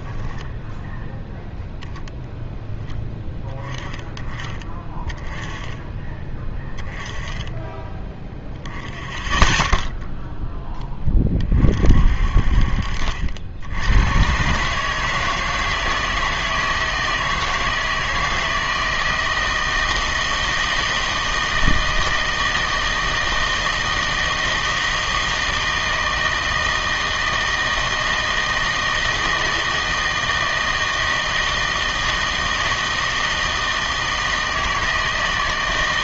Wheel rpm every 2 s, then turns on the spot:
10, 0, 20, 10, 0, 10, 50, 130, 160, 160, 160, 160, 160, 160, 160, 160, 160, 160.
0-2